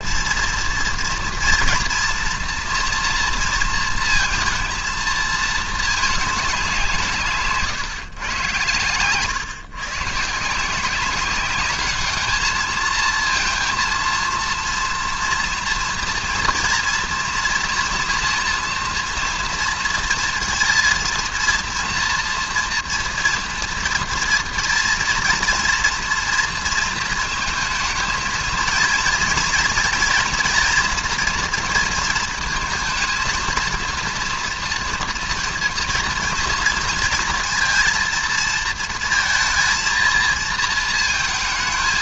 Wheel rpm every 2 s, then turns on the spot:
230, 230, 220, 170, 110, 170, 220, 240, 230, 230, 230, 230, 230, 230, 230, 240, 230, 230, 230, 230, 220.
none